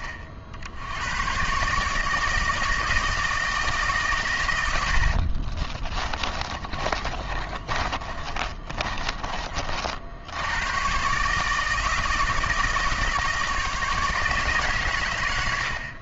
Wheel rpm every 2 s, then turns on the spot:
80, 160, 80, 30, 30, 130, 160, 110.
4-10